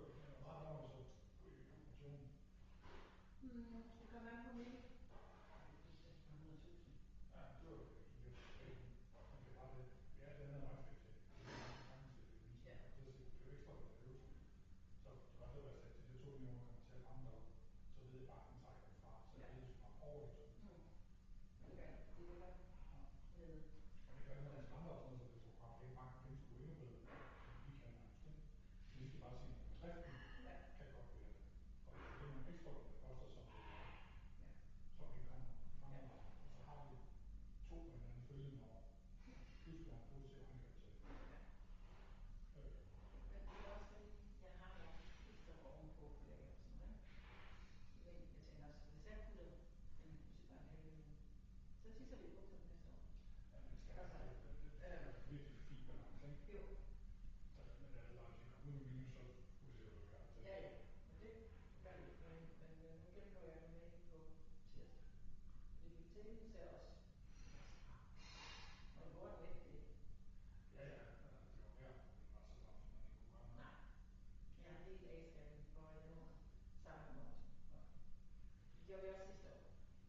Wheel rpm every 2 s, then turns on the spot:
0, 0, 0, 0, 0, 0, 0, 0, 0, 0, 0, 0, 0, 0, 0, 0, 0, 0, 0, 0, 0, 0, 0, 0, 0, 0, 0, 0, 0, 0, 0, 0, 0, 0, 0, 0, 0, 0, 0, 0.
none